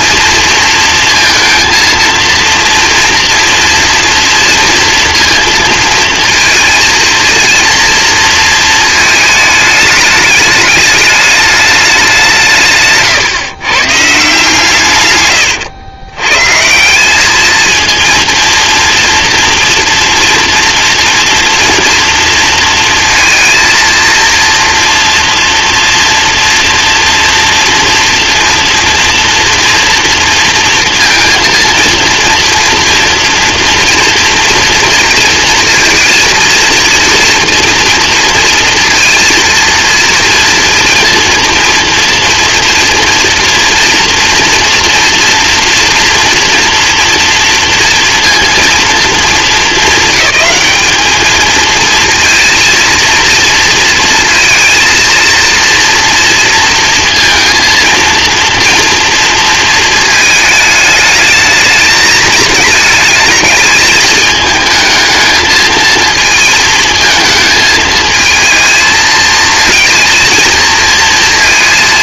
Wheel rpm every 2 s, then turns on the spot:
230, 230, 230, 230, 220, 210, 150, 150, 150, 230, 230, 230, 230, 230, 230, 230, 240, 230, 230, 230, 230, 230, 230, 230, 220, 200, 230, 230, 230, 230, 220, 220, 220, 220, 220, 230.
none